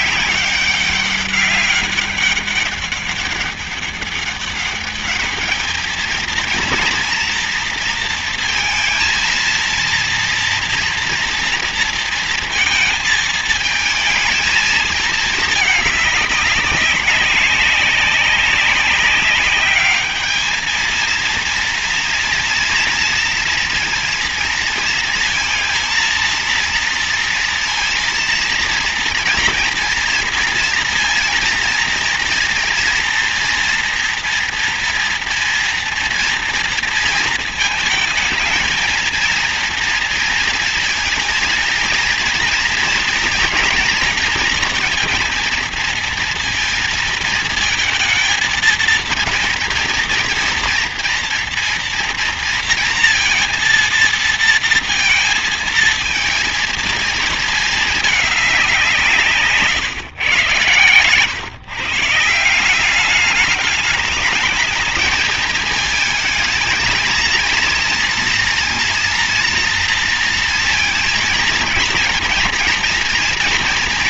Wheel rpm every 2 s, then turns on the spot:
200, 200, 200, 230, 230, 230, 230, 220, 200, 190, 210, 230, 230, 230, 230, 230, 230, 230, 230, 230, 230, 230, 240, 230, 230, 230, 230, 230, 230, 200, 130, 170, 210, 220, 230, 230, 230.
none